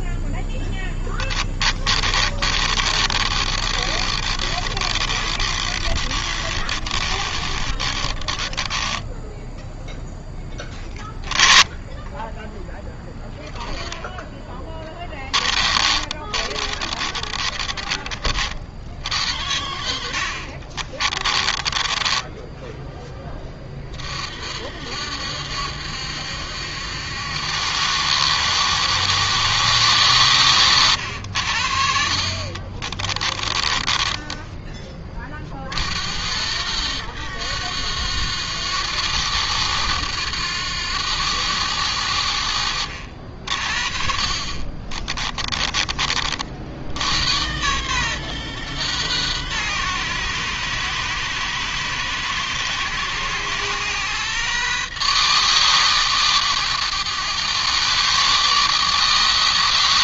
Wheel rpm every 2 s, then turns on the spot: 10, 30, 30, 30, 20, 20, 10, 20, 30, 60, 30, 10, 70, 70, 80, 80, 30, 20, 100, 90, 90, 60, 30, 80, 120, 110, 110, 130, 110, 140.
0-10 14-18 20-22 32-34 44-46